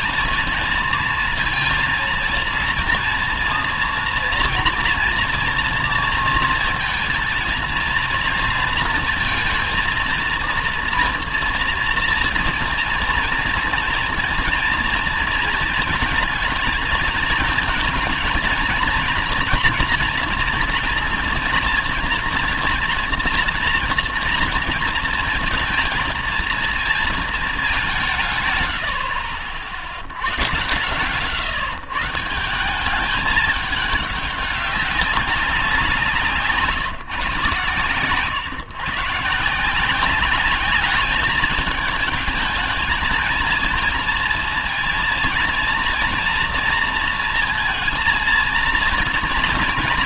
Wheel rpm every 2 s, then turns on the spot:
230, 230, 230, 230, 230, 230, 230, 230, 230, 230, 230, 230, 230, 230, 130, 110, 170, 200, 180, 130, 200, 220, 230, 240, 230.
none